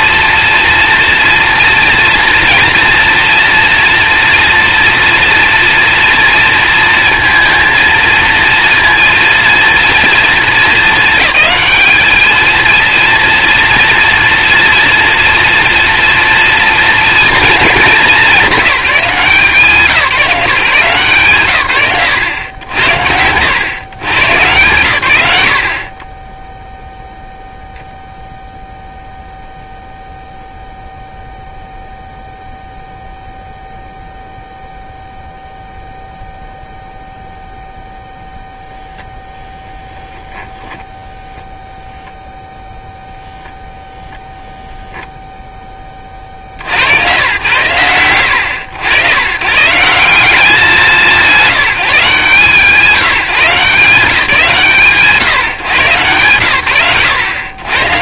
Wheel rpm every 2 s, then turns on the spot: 230, 240, 230, 230, 230, 210, 230, 230, 220, 160, 100, 100, 80, 0, 0, 0, 0, 0, 0, 0, 10, 0, 0, 60, 100, 190, 160, 160, 100.
none